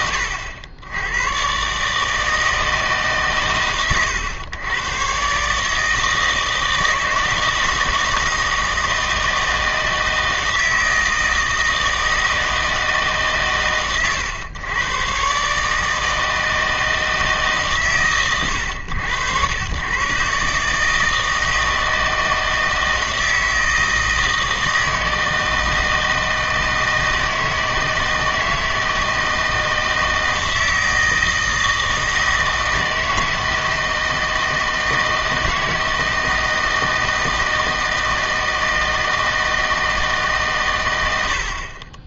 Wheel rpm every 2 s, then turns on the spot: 90, 160, 110, 160, 160, 160, 160, 110, 160, 110, 150, 160, 160, 160, 160, 160, 160, 160, 160, 160, 120.
none